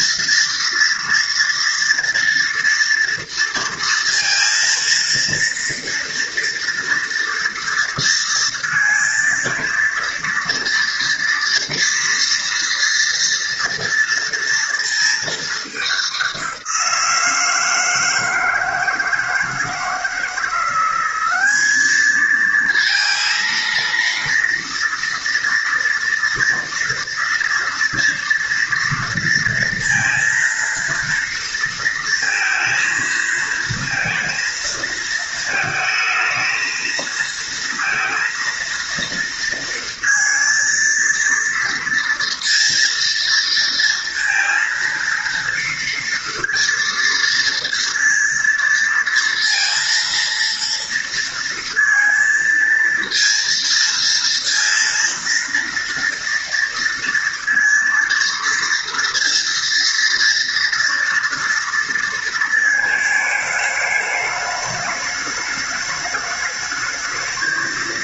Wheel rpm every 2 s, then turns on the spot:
230, 230, 230, 230, 230, 230, 230, 230, 180, 160, 180, 230, 230, 240, 230, 230, 230, 230, 220, 230, 230, 230, 230, 230, 230, 230, 230, 230, 230, 230, 230, 220, 210, 210.
none